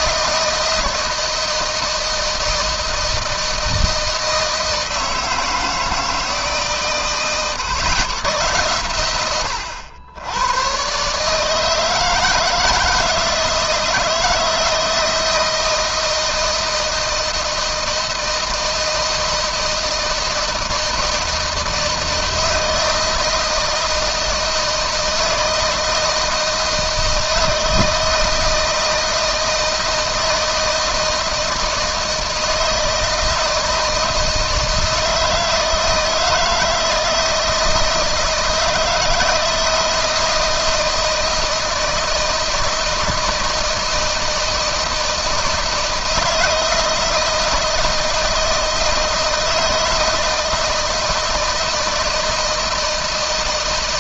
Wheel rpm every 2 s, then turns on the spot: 160, 160, 160, 140, 110, 120, 160, 160, 170, 160, 170, 160, 160, 160, 160, 160, 160, 160, 160, 160, 160, 160, 160, 160, 160, 160, 160.
none